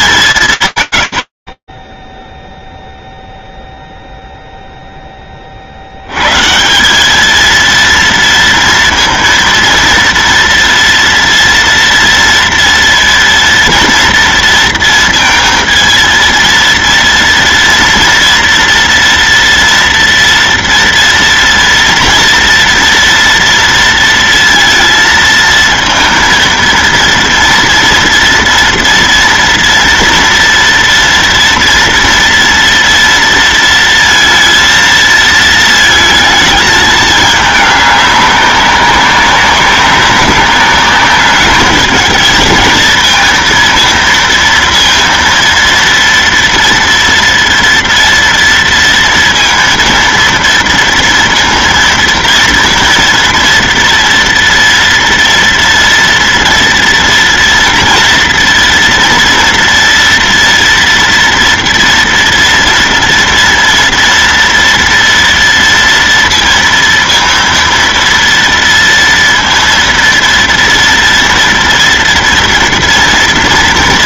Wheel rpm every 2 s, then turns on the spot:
100, 0, 20, 210, 230, 230, 230, 230, 230, 230, 230, 230, 230, 230, 230, 230, 230, 220, 210, 190, 200, 220, 230, 230, 230, 230, 230, 240, 230, 230, 230, 230, 230, 230, 230, 230, 230.
none